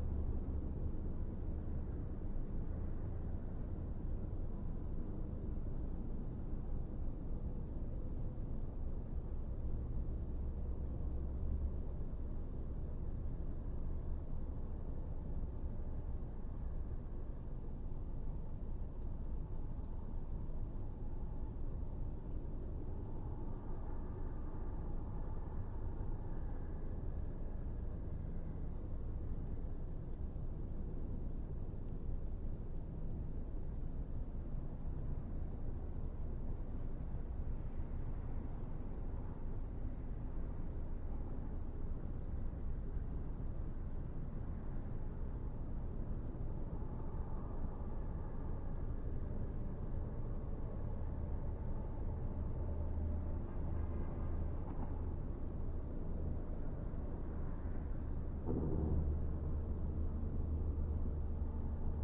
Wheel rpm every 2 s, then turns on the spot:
0, 0, 0, 0, 0, 0, 0, 0, 0, 0, 0, 0, 0, 0, 0, 0, 0, 0, 0, 0, 0, 0, 0, 0, 0, 0, 0, 0, 0, 0, 0.
none